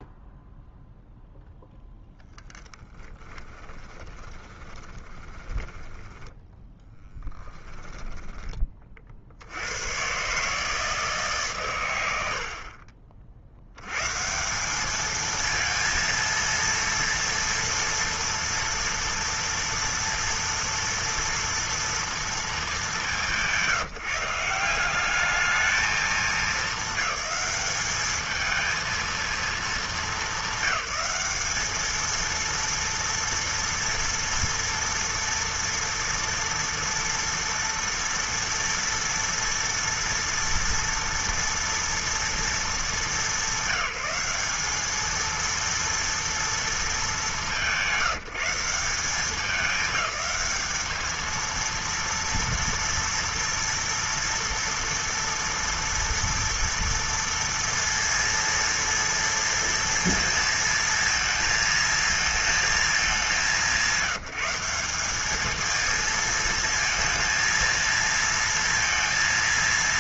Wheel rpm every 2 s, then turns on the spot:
0, 10, 30, 10, 10, 130, 90, 140, 230, 240, 230, 230, 170, 220, 220, 200, 230, 240, 230, 240, 230, 240, 200, 230, 180, 210, 230, 230, 230, 230, 230, 220, 190, 220, 230.
4-10